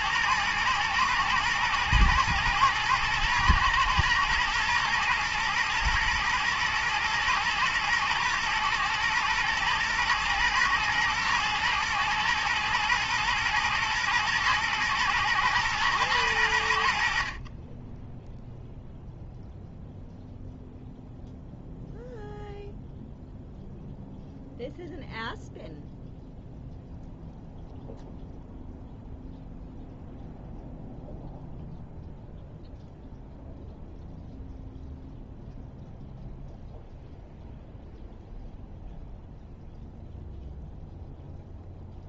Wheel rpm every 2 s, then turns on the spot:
110, 110, 120, 120, 110, 110, 110, 110, 80, 0, 0, 0, 0, 0, 0, 0, 0, 0, 0, 0, 0.
none